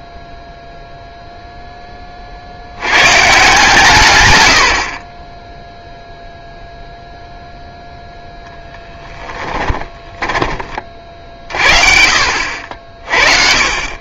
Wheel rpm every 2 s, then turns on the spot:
0, 60, 90, 0, 10, 30, 50.
8-10